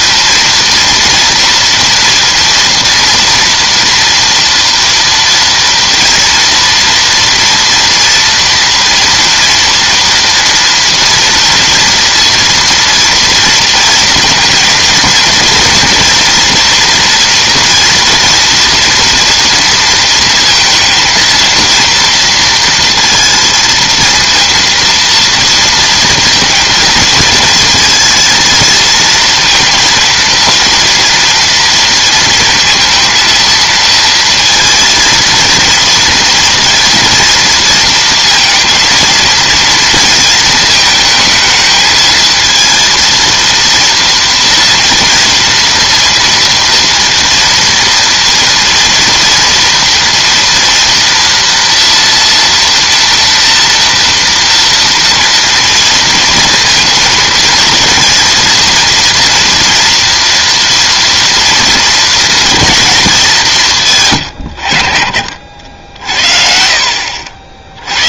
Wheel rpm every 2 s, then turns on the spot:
230, 230, 230, 230, 230, 230, 230, 230, 230, 240, 230, 230, 230, 220, 230, 230, 220, 230, 230, 230, 220, 230, 230, 230, 240, 240, 230, 230, 230, 230, 230, 230, 90, 60.
none